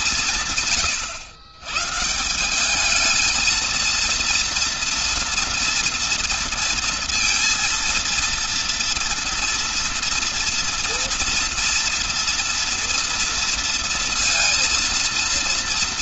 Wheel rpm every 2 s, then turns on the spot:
110, 220, 230, 230, 230, 230, 230, 230.
none